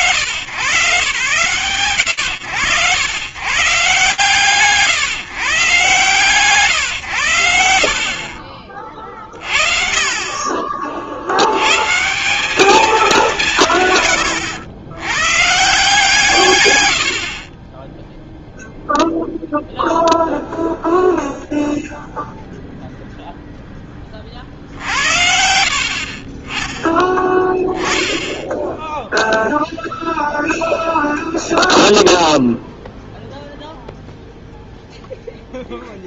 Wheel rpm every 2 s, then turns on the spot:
130, 140, 140, 150, 40, 30, 190, 110, 140, 0, 0, 0, 40, 40, 10, 0, 0, 0.
none